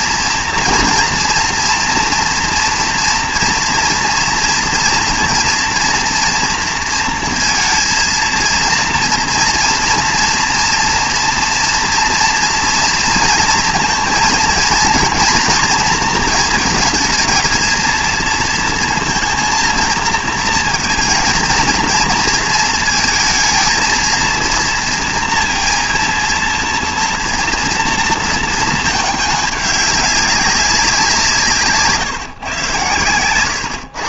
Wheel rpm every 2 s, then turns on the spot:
230, 230, 230, 230, 230, 230, 230, 230, 230, 230, 230, 230, 230, 230, 220, 190, 120.
none